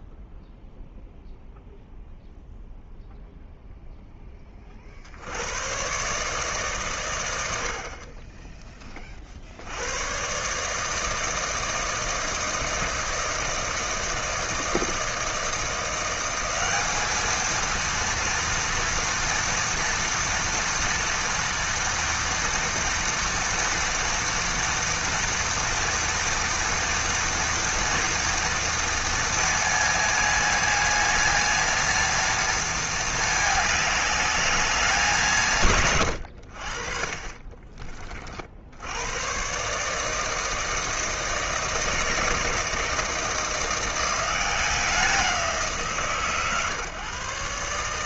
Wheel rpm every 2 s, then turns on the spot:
0, 0, 40, 130, 20, 150, 160, 160, 200, 230, 230, 230, 230, 230, 230, 230, 220, 200, 50, 80, 160, 160, 180, 140.
none